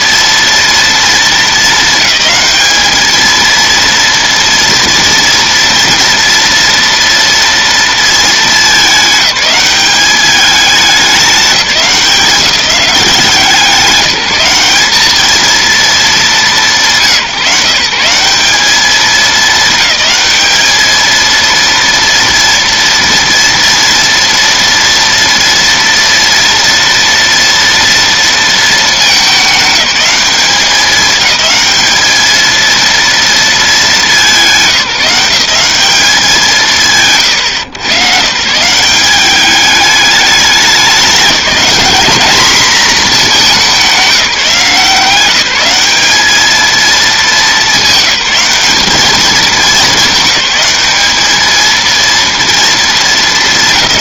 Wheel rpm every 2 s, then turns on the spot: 230, 210, 230, 230, 220, 200, 190, 210, 170, 210, 220, 230, 230, 230, 220, 210, 230, 180, 150, 160, 200, 220, 170, 220, 210, 210, 230.
none